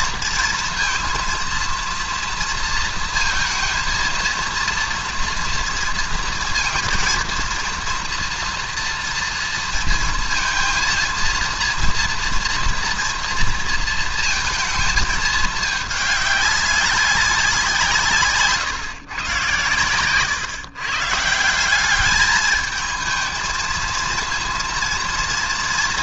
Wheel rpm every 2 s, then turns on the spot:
230, 230, 230, 240, 240, 230, 230, 230, 200, 160, 110, 200, 230.
none